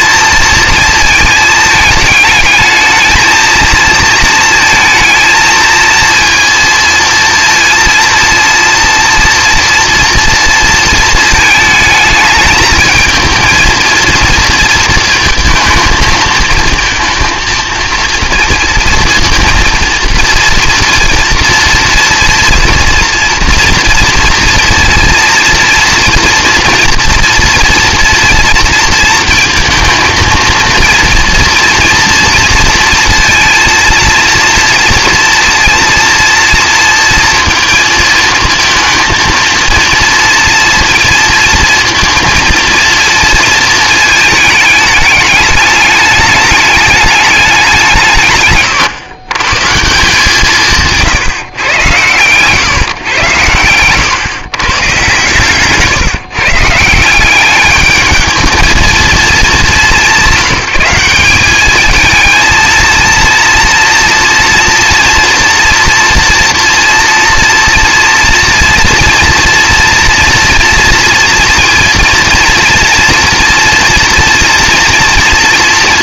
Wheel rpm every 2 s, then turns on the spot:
230, 220, 230, 230, 230, 230, 220, 230, 220, 230, 240, 230, 230, 240, 230, 230, 230, 230, 230, 230, 230, 230, 220, 210, 150, 160, 130, 130, 160, 220, 190, 230, 230, 230, 230, 240, 230, 240.
50-52